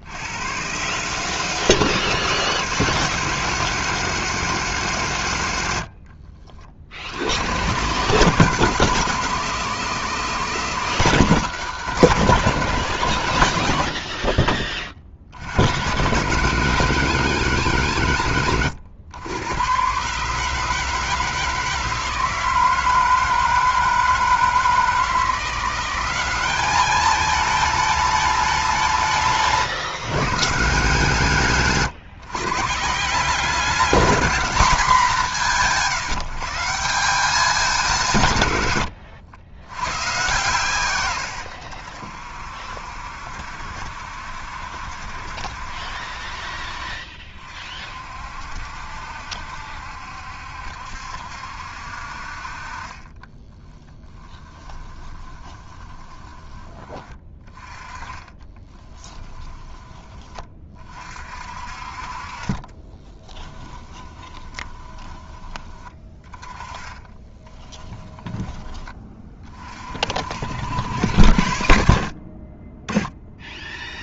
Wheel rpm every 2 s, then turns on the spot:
90, 160, 160, 50, 150, 160, 140, 40, 130, 120, 140, 160, 160, 190, 210, 150, 140, 210, 160, 150, 130, 60, 70, 50, 60, 70, 50, 20, 20, 20, 30, 30, 20, 20, 10, 50, 40.
6-8 54-60 64-66 68-70